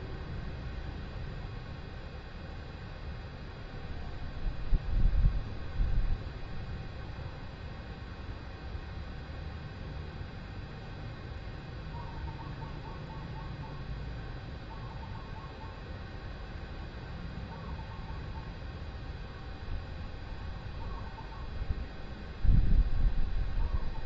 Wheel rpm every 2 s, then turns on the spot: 0, 0, 0, 0, 0, 0, 0, 0, 0, 0, 0, 0.
none